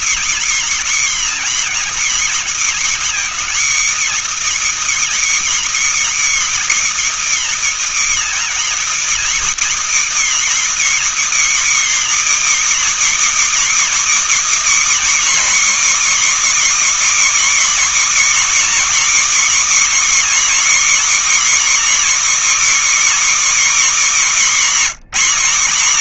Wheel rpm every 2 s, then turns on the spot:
300, 290, 320, 320, 310, 310, 310, 300, 310, 290, 290, 310, 260.
none